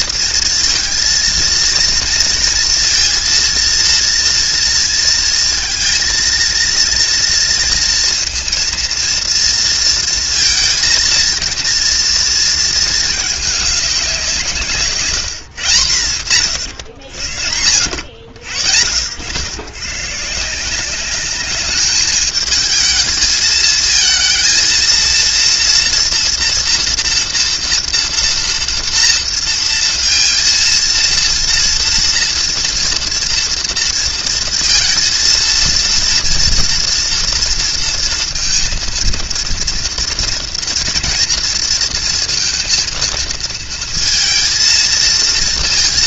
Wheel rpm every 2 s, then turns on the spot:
230, 230, 230, 230, 230, 230, 230, 170, 110, 70, 180, 220, 230, 230, 230, 230, 230, 230, 240, 230, 230, 230, 230.
none